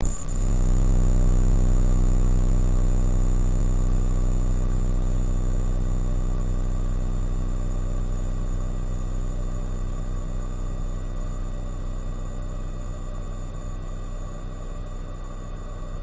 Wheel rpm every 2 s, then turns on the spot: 0, 0, 0, 0, 0, 0, 0, 0.
none